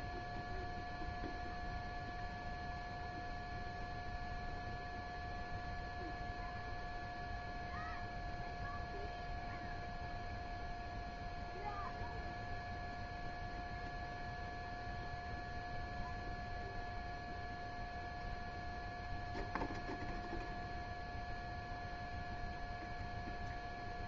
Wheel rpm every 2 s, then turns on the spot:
0, 0, 0, 0, 0, 0, 0, 0, 0, 0, 0, 0.
none